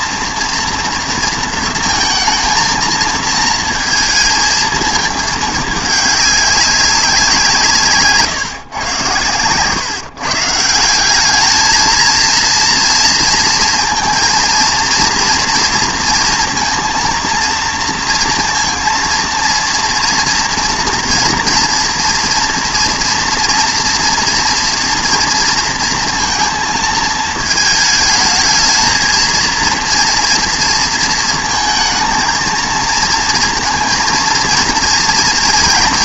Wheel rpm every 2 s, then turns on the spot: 240, 220, 220, 200, 130, 160, 230, 230, 230, 230, 230, 230, 240, 230, 220, 230, 230, 230.
none